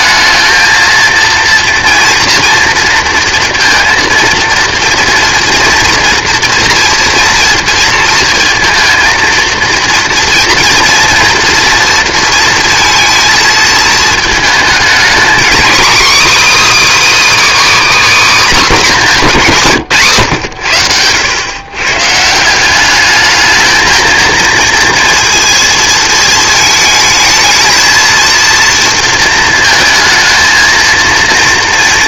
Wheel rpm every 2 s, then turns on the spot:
220, 230, 230, 230, 230, 230, 230, 230, 320, 250, 100, 200, 230, 220, 230, 230.
none